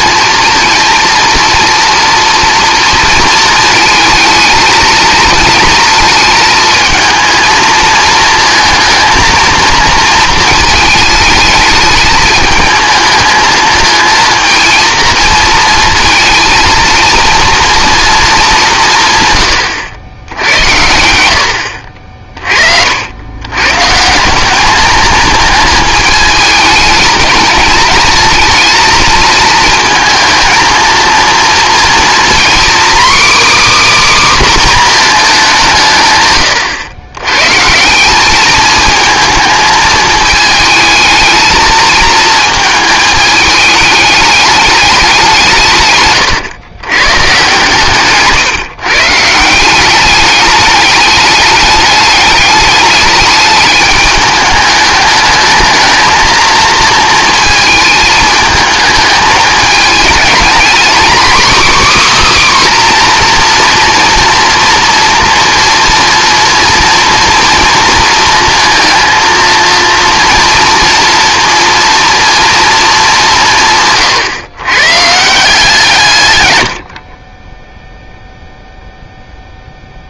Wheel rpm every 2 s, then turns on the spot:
230, 230, 220, 220, 230, 220, 220, 230, 230, 180, 80, 60, 210, 220, 230, 230, 270, 260, 110, 220, 220, 220, 210, 120, 140, 210, 210, 210, 230, 210, 230, 270, 240, 230, 230, 240, 220, 130, 80, 0.
none